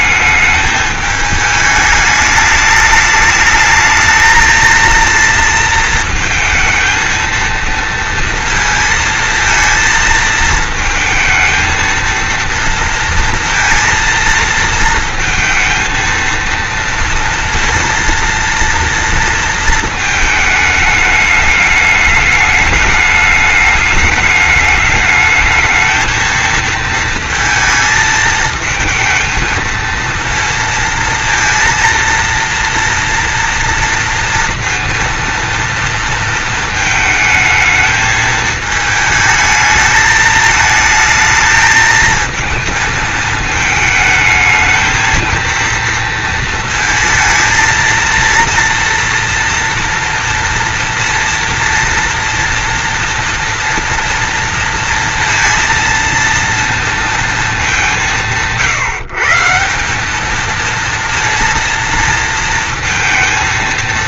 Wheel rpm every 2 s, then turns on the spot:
210, 220, 230, 220, 230, 230, 230, 230, 230, 230, 220, 210, 210, 220, 220, 230, 230, 230, 220, 220, 220, 220, 220, 230, 230, 230, 230, 230, 230, 150, 220, 230.
none